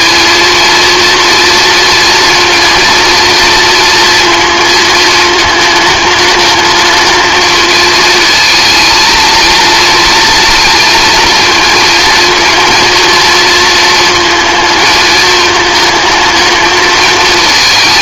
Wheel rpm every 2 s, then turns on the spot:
230, 230, 230, 220, 230, 230, 230, 220, 220.
none